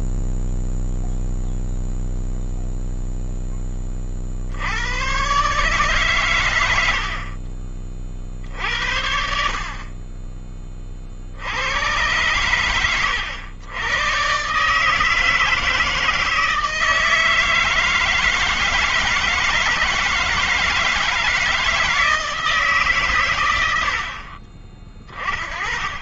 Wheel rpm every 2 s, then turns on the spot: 0, 0, 90, 80, 70, 20, 90, 150, 160, 160, 160, 140, 30.
none